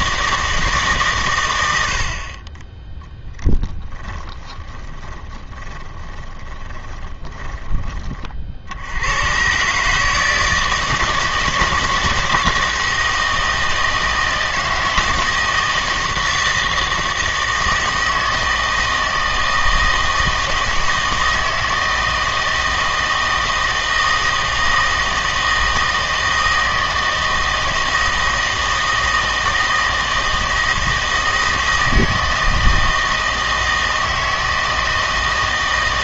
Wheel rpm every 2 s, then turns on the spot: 160, 20, 20, 20, 70, 160, 160, 160, 160, 160, 160, 160, 160, 160, 160, 160, 160, 160.
4-8